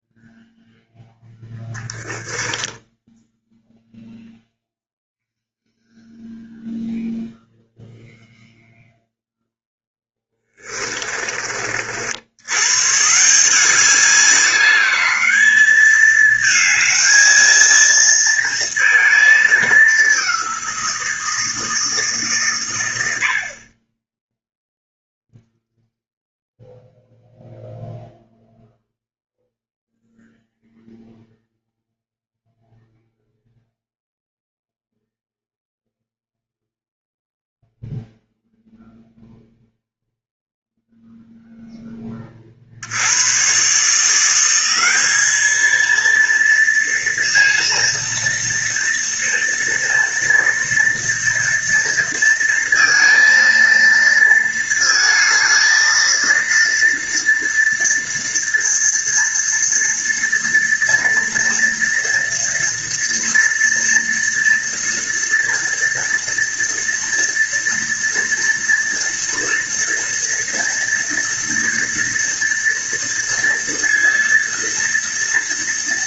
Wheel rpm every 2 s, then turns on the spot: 0, 10, 0, 0, 0, 20, 140, 200, 220, 220, 180, 90, 0, 0, 0, 0, 0, 0, 0, 0, 0, 80, 200, 230, 230, 230, 230, 220, 230, 230, 230, 230, 230, 230, 230, 230, 230, 230.
10-12